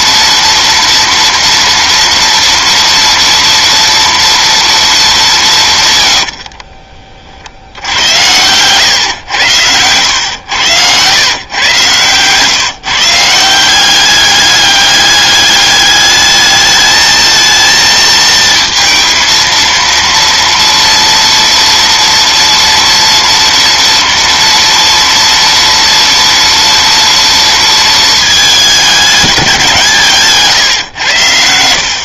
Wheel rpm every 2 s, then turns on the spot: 230, 230, 230, 50, 120, 100, 150, 200, 220, 230, 230, 230, 230, 230, 210, 140.
6-8